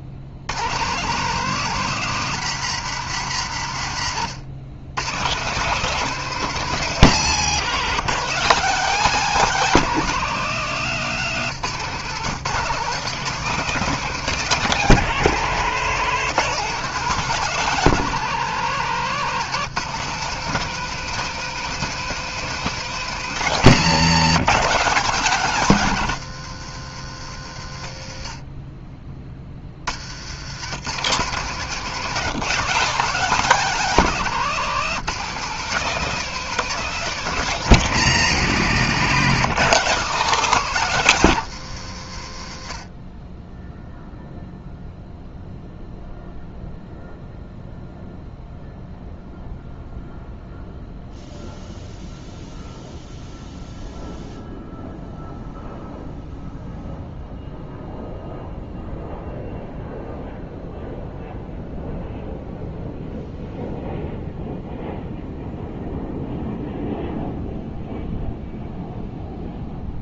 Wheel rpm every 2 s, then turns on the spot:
80, 170, 120, 180, 180, 170, 160, 190, 170, 160, 190, 200, 180, 110, 30, 130, 180, 170, 200, 150, 170, 40, 0, 0, 0, 0, 0, 0, 0, 0, 0, 0, 0, 0, 0.
34-36